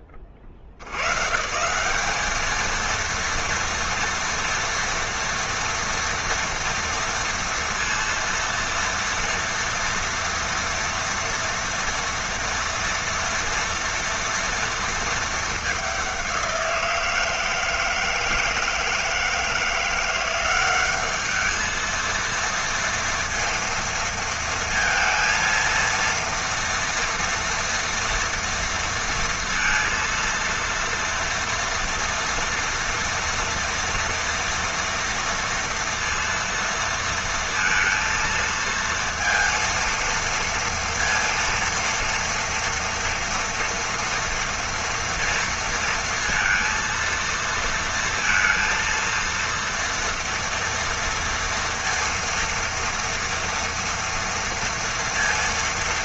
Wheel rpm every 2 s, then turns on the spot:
80, 230, 230, 230, 230, 230, 230, 220, 170, 160, 200, 230, 230, 230, 230, 240, 230, 230, 230, 230, 230, 230, 230, 230, 230, 230, 230, 230.
none